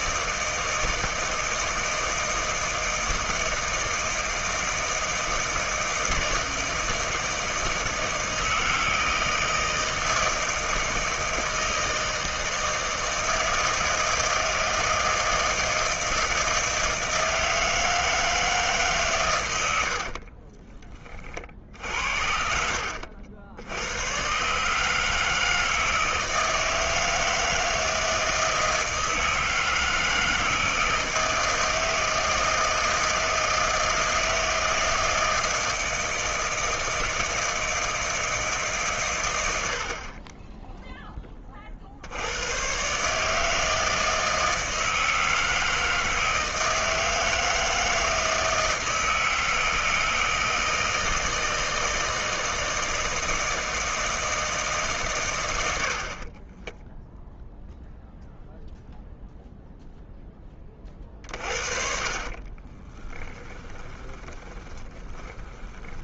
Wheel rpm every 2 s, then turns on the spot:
160, 160, 160, 160, 160, 160, 160, 160, 160, 150, 20, 70, 140, 160, 160, 160, 160, 160, 160, 140, 10, 110, 160, 160, 160, 160, 160, 150, 10, 0, 20, 30, 20.
56-58 62-66